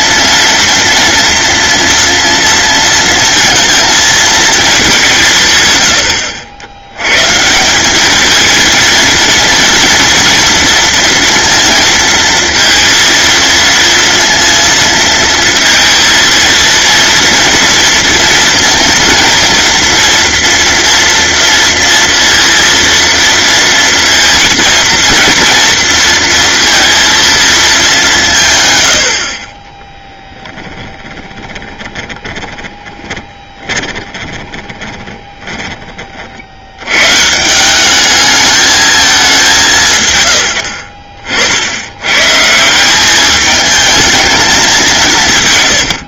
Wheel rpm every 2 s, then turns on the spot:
230, 230, 200, 100, 230, 230, 230, 230, 230, 230, 230, 230, 220, 230, 110, 10, 20, 20, 110, 210, 70, 180, 190.
30-36